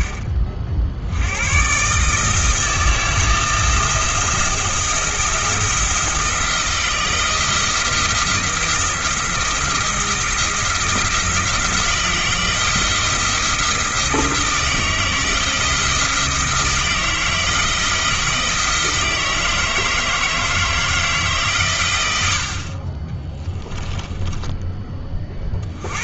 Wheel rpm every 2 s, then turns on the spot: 60, 160, 170, 170, 170, 170, 170, 170, 160, 160, 160, 40, 20.
none